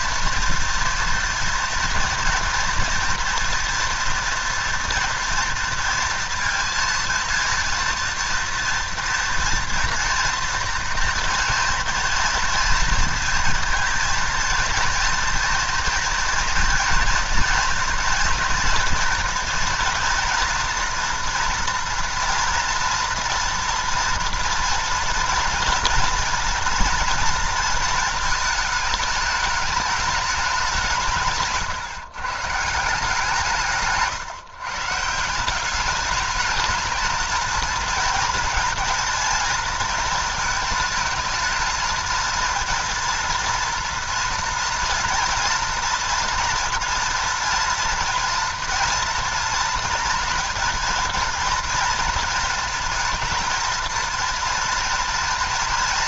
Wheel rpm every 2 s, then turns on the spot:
230, 230, 230, 230, 240, 230, 230, 230, 230, 230, 230, 230, 230, 230, 220, 180, 160, 140, 210, 230, 220, 230, 230, 240, 230, 230, 230, 230.
none